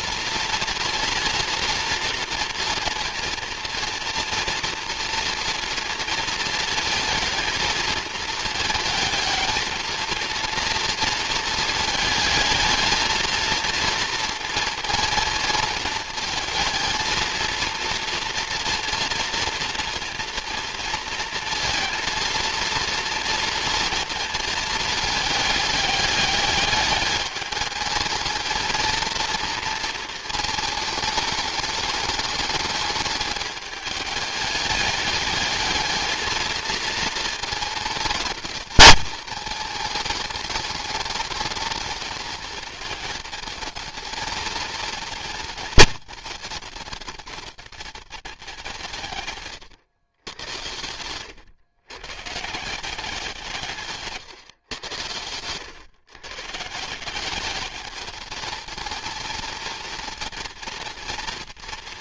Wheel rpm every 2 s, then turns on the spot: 230, 230, 230, 230, 220, 230, 220, 230, 230, 230, 230, 230, 220, 210, 230, 220, 210, 210, 220, 210, 210, 220, 230, 210, 170, 100, 170, 120, 160, 220, 230.
none